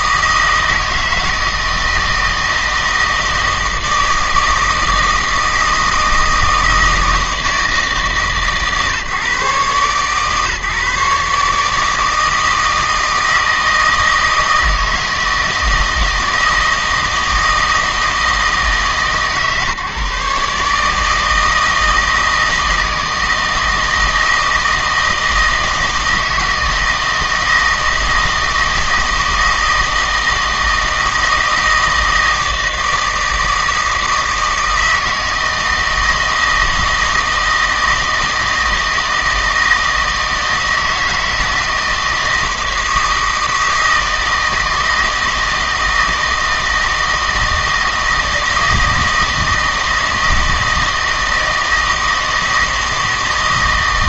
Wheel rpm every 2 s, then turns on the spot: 160, 160, 160, 160, 150, 140, 160, 160, 160, 150, 150, 160, 160, 160, 160, 160, 160, 160, 160, 160, 160, 160, 160, 160, 160, 160, 160.
none